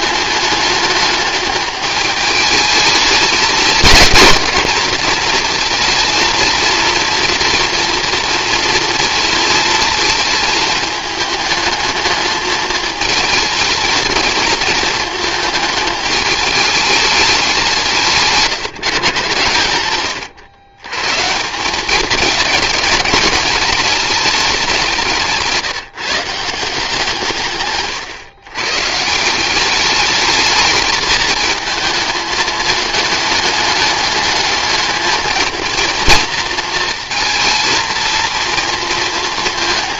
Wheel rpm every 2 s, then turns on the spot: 210, 210, 220, 230, 230, 220, 220, 220, 210, 150, 120, 210, 180, 160, 140, 210, 210, 210, 230, 230.
none